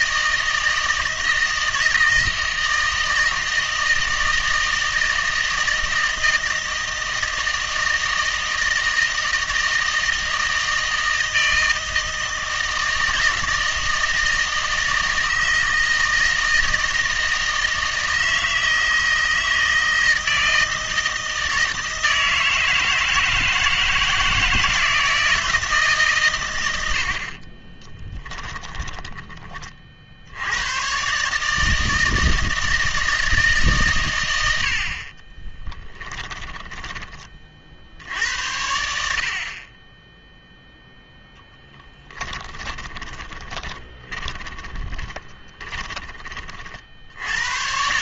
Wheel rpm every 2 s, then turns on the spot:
160, 160, 160, 160, 160, 160, 160, 160, 160, 160, 160, 160, 160, 80, 20, 120, 160, 60, 20, 70, 0, 20, 20, 60.
28-30 36-38 42-46